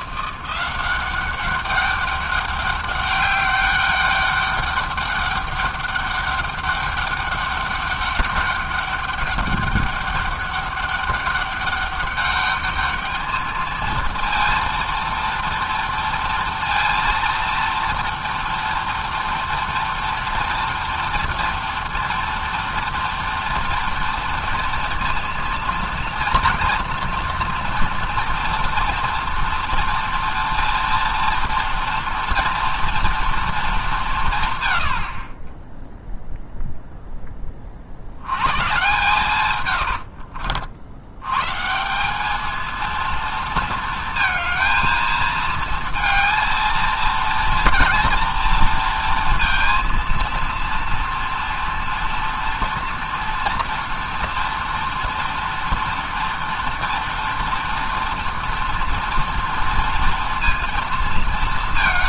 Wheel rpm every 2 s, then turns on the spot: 190, 200, 200, 200, 200, 200, 220, 230, 230, 230, 240, 230, 230, 230, 230, 230, 220, 30, 10, 130, 120, 230, 230, 240, 230, 230, 230, 230, 230, 230, 230.
38-40